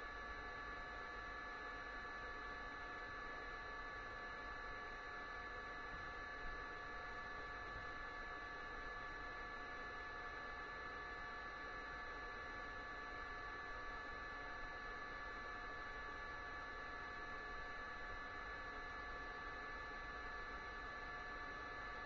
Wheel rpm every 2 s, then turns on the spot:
0, 0, 0, 0, 0, 0, 0, 0, 0, 0, 0.
none